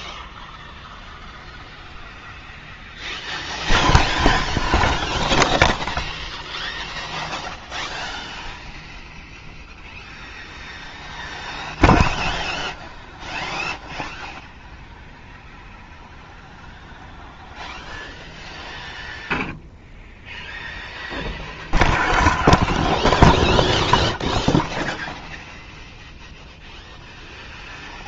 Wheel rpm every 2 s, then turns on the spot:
0, 0, 0, 0, 0, 0, 0, 0, 0, 0, 0, 0, 0, 0.
none